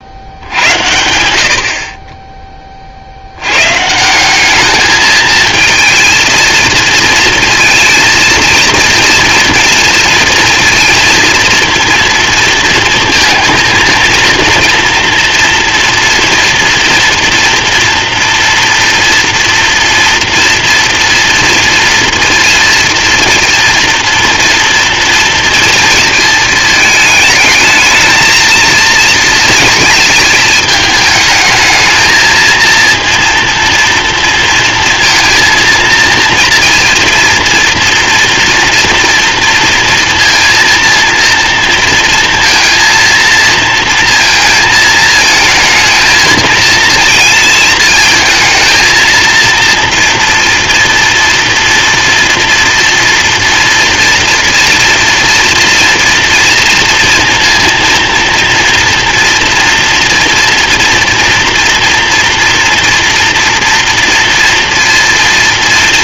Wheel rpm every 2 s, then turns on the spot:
80, 30, 210, 230, 230, 230, 230, 230, 230, 230, 230, 230, 240, 220, 230, 220, 230, 230, 230, 230, 230, 230, 230, 230, 230, 230, 230, 230, 230, 240, 230, 240, 230.
none